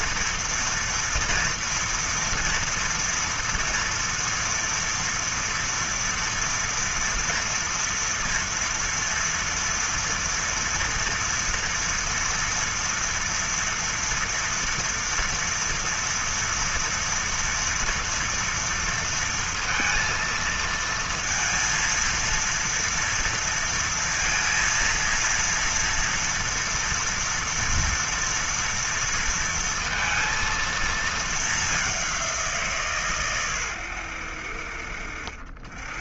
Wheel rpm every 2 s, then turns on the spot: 240, 240, 240, 240, 230, 230, 230, 230, 230, 230, 230, 230, 230, 230, 230, 230, 170, 60.
none